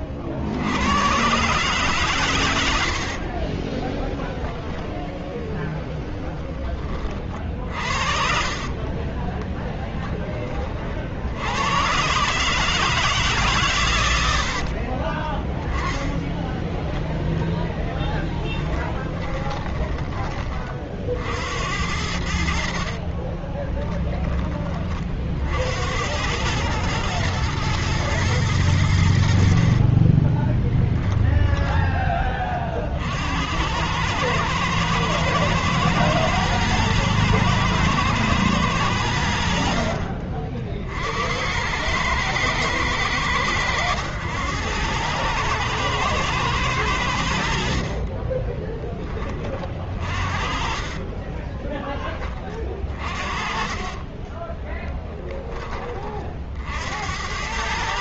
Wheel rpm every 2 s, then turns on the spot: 90, 80, 10, 30, 20, 80, 140, 20, 10, 20, 60, 30, 50, 120, 80, 10, 60, 110, 110, 90, 60, 100, 100, 90, 10, 30, 30, 10, 60.
2-4 6-10 14-16 22-24 50-52 54-56